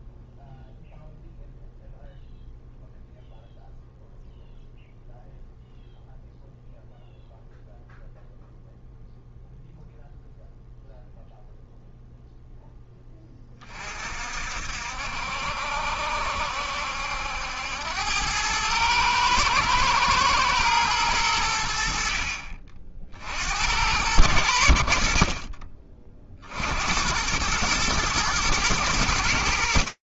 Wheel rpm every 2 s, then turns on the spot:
0, 0, 0, 0, 0, 0, 0, 60, 70, 100, 110, 50, 80, 70, 120.
none